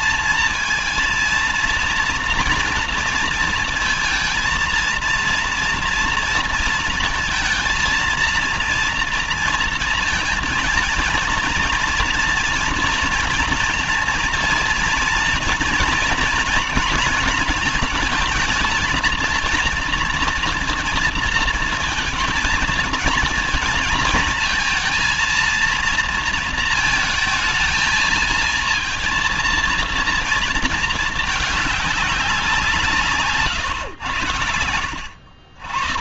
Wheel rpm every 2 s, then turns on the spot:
220, 230, 230, 230, 230, 230, 230, 230, 230, 220, 230, 230, 230, 230, 220, 220, 180, 90.
none